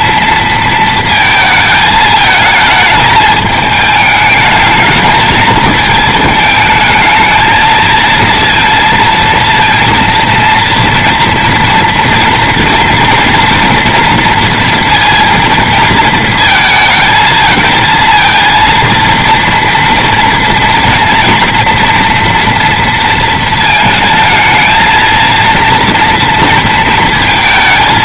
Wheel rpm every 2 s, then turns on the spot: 230, 220, 220, 220, 230, 240, 240, 230, 220, 230, 230, 230, 230, 220.
none